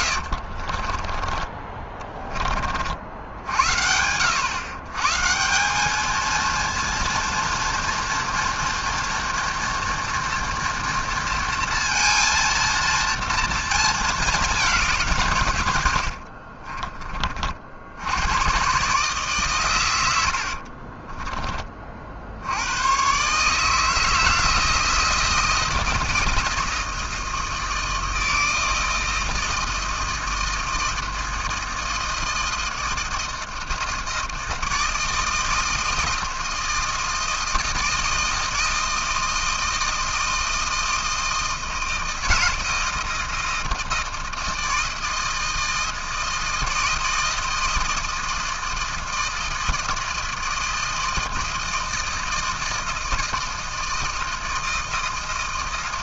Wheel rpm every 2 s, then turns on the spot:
30, 70, 160, 230, 240, 230, 230, 140, 30, 130, 20, 140, 160, 160, 160, 170, 160, 160, 160, 160, 160, 160, 160, 160, 160, 160, 160, 160.
0-2